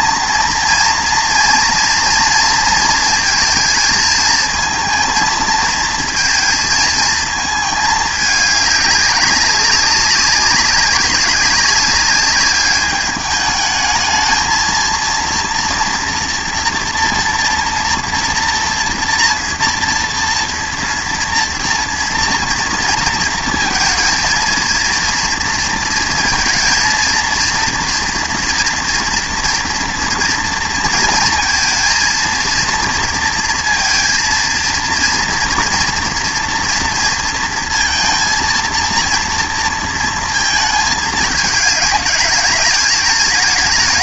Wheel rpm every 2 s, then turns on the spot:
230, 230, 230, 230, 200, 200, 200, 230, 240, 230, 240, 230, 230, 230, 230, 230, 230, 230, 230, 230, 220, 220.
none